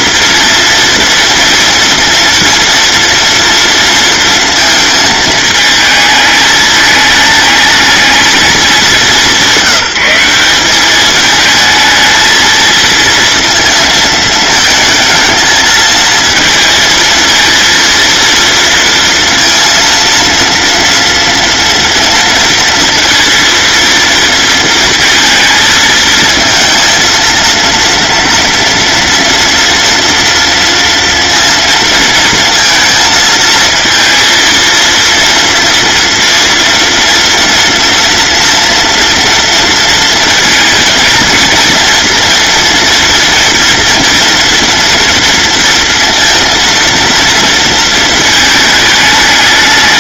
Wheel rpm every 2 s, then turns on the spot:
240, 230, 220, 210, 210, 200, 230, 220, 220, 230, 230, 230, 230, 230, 230, 230, 230, 230, 230, 230, 230, 230, 230, 230, 210.
none